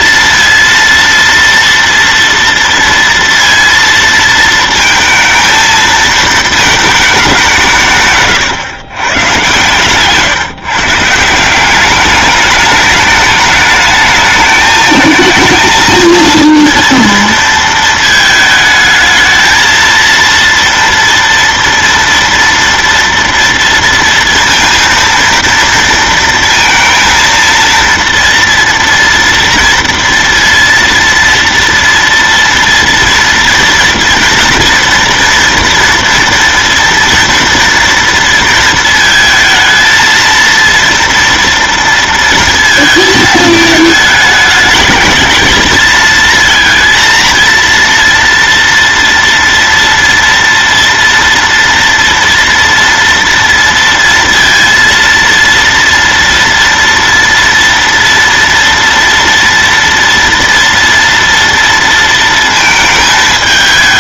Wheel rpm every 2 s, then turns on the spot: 230, 230, 220, 220, 130, 140, 210, 220, 230, 220, 230, 230, 230, 230, 240, 230, 230, 230, 230, 230, 230, 230, 210, 230, 230, 230, 230, 230, 230, 230, 230, 230.
none